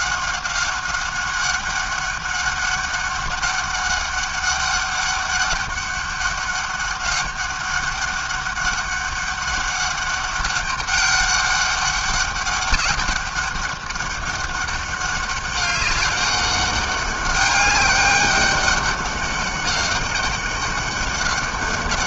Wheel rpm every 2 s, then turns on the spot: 190, 200, 200, 200, 200, 200, 200, 200, 200, 200, 200.
none